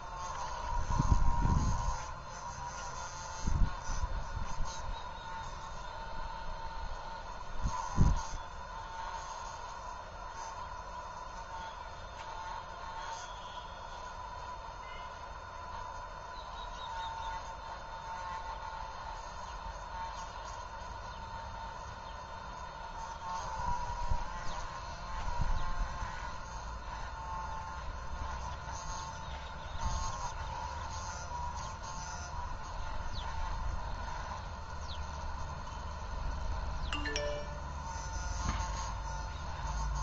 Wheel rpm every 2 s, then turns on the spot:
0, 0, 0, 0, 0, 0, 0, 0, 0, 0, 0, 0, 0, 0, 0, 0, 0, 0, 0, 0.
none